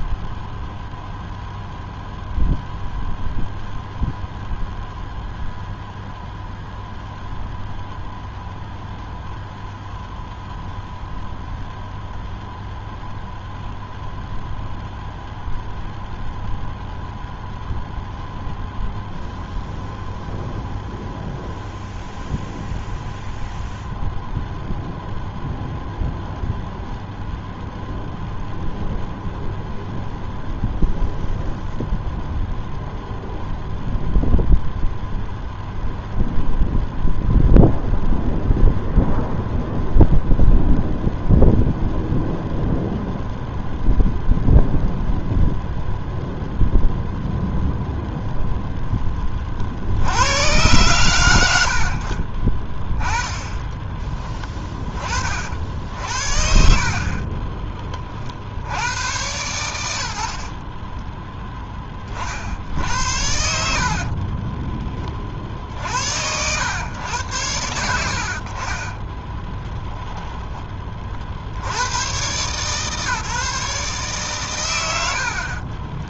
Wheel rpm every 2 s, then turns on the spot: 0, 0, 0, 0, 0, 0, 0, 0, 0, 0, 0, 0, 0, 0, 0, 0, 0, 0, 0, 0, 0, 0, 0, 0, 10, 100, 20, 20, 50, 90, 20, 70, 10, 100, 20, 30, 150, 80.
60-62 68-70